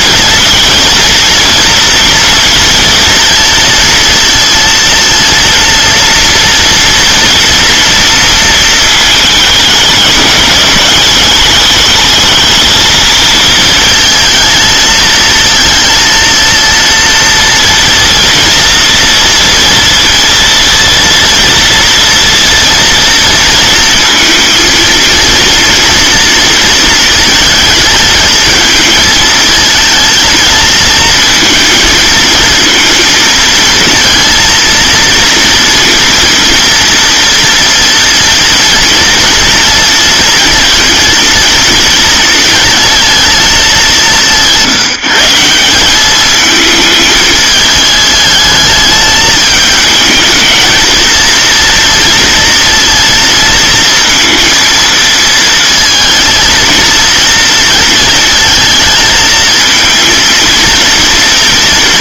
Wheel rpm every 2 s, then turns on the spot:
240, 230, 230, 230, 230, 210, 220, 220, 230, 230, 230, 230, 230, 230, 220, 220, 230, 230, 230, 230, 230, 230, 170, 220, 220, 220, 230, 230, 230, 220, 230.
none